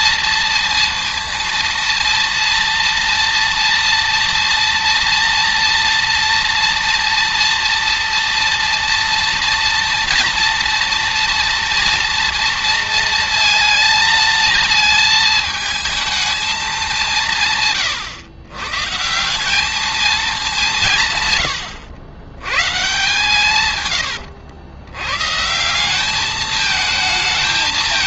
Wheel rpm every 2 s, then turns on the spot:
230, 230, 230, 230, 230, 230, 230, 220, 200, 140, 180, 110, 100, 220.
none